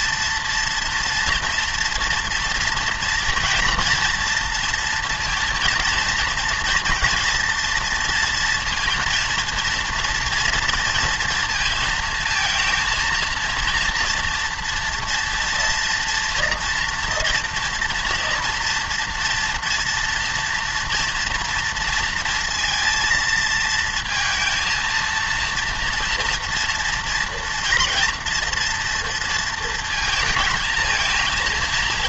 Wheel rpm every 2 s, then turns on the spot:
230, 230, 230, 230, 230, 230, 230, 230, 230, 230, 230, 230, 230, 230, 230, 220.
none